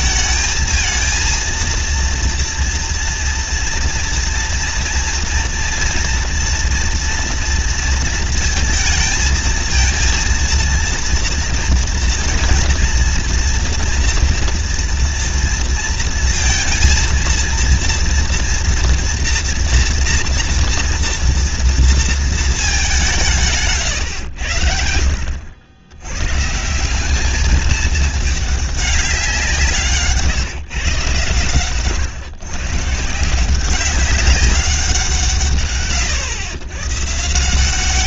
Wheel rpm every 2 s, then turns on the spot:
230, 230, 230, 230, 230, 230, 230, 240, 230, 230, 230, 210, 80, 160, 210, 150, 140, 190, 110.
none